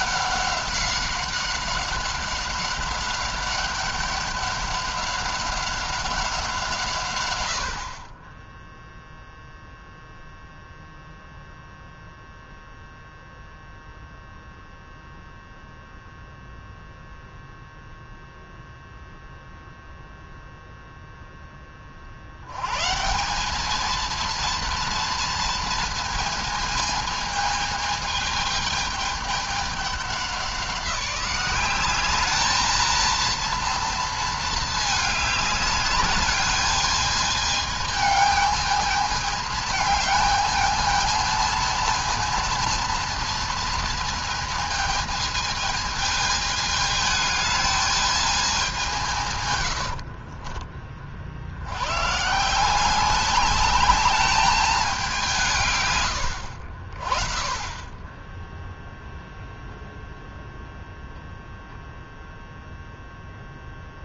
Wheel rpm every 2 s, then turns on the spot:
190, 190, 200, 180, 10, 0, 0, 0, 0, 0, 0, 90, 230, 220, 210, 190, 210, 220, 210, 220, 220, 230, 220, 210, 200, 30, 150, 210, 90, 10, 0, 0.
50-52